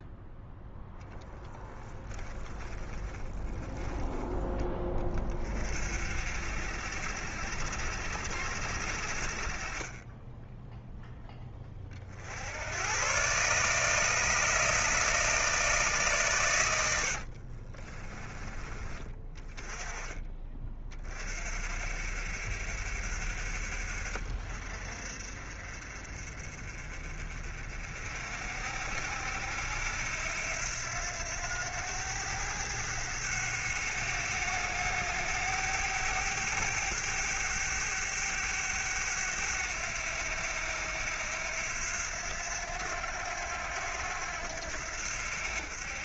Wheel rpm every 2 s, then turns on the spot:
0, 20, 30, 60, 50, 10, 120, 140, 70, 30, 40, 60, 50, 40, 80, 90, 100, 100, 100, 100, 90, 90, 80.
2-4 16-18